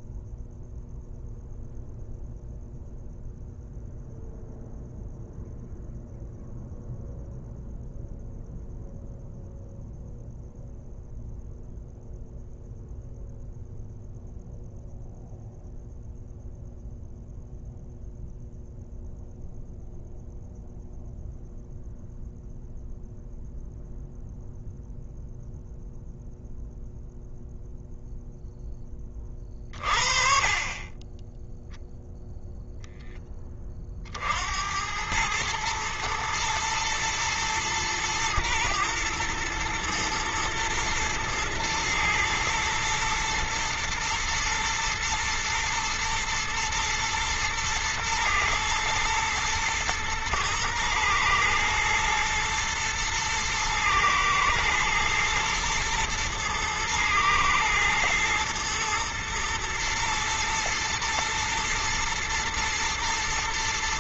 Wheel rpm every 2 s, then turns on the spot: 0, 0, 0, 0, 0, 0, 0, 0, 0, 0, 0, 0, 0, 0, 10, 20, 10, 100, 120, 120, 110, 110, 110, 110, 110, 110, 110, 120, 120, 120, 110, 110.
none